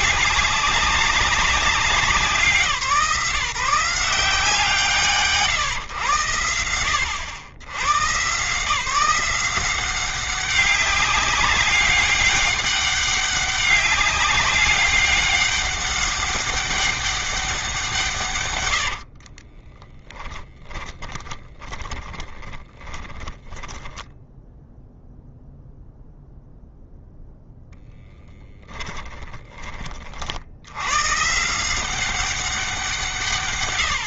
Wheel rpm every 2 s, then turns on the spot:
200, 170, 170, 100, 150, 200, 200, 200, 200, 140, 20, 20, 0, 0, 10, 50, 190.
18-24 28-30